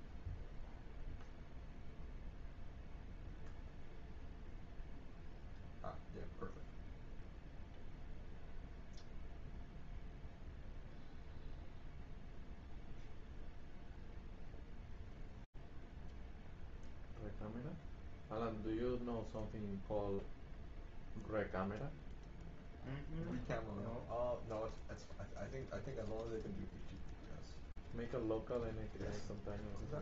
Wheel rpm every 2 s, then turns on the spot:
0, 0, 0, 0, 0, 0, 0, 0, 0, 0, 0, 0, 0, 0, 0.
none